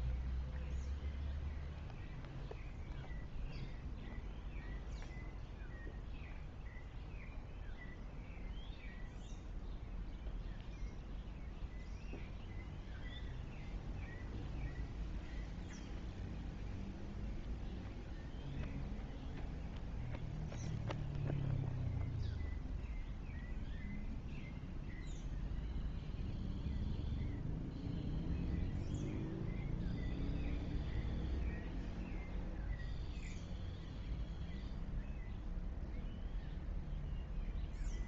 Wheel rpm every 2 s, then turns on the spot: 0, 0, 0, 0, 0, 0, 0, 0, 0, 0, 0, 0, 0, 0, 0, 0, 0, 0, 0.
none